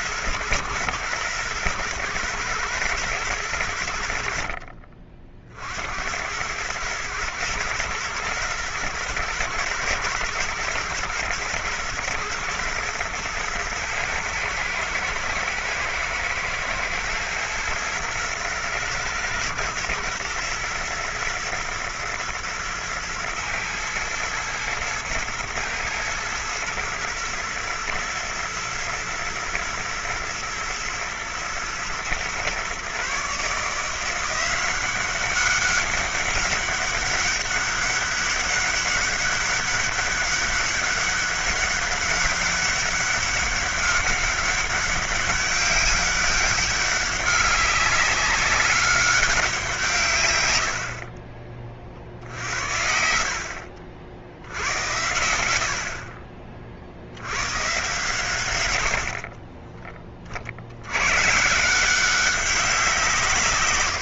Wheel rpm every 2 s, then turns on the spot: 110, 110, 60, 90, 110, 110, 120, 110, 110, 110, 110, 110, 110, 110, 110, 110, 120, 170, 200, 200, 200, 200, 200, 200, 190, 120, 50, 60, 40, 120, 50, 190.
none